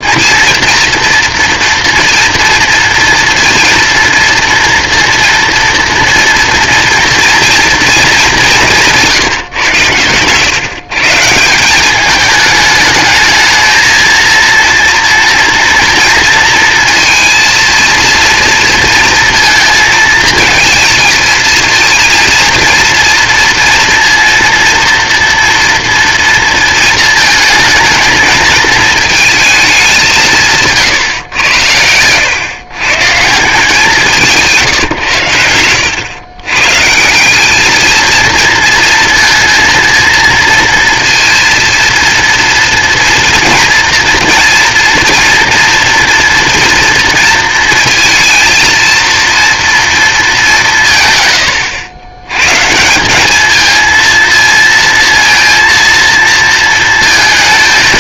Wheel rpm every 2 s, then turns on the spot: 230, 230, 230, 230, 190, 130, 210, 230, 230, 230, 220, 230, 230, 230, 220, 150, 120, 150, 130, 230, 230, 230, 230, 240, 230, 190, 130, 220, 230.
30-32